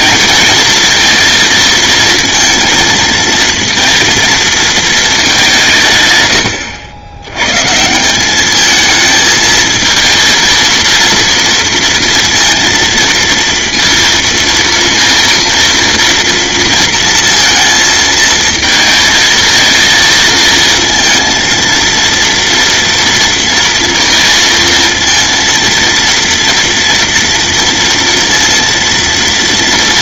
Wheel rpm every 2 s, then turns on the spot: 230, 230, 220, 90, 220, 230, 230, 230, 230, 220, 220, 230, 230, 230, 230.
none